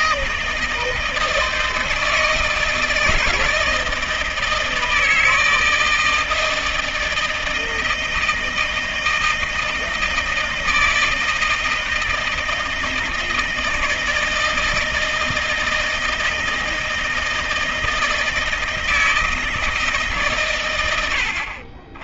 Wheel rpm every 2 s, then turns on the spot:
160, 160, 160, 160, 160, 160, 160, 160, 160, 160, 120.
none